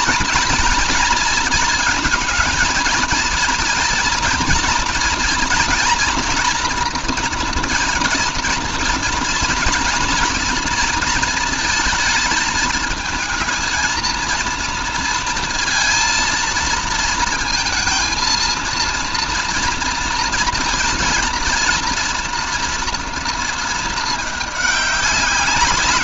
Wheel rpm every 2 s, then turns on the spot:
230, 230, 230, 230, 230, 230, 220, 230, 230, 230, 230, 230, 200.
none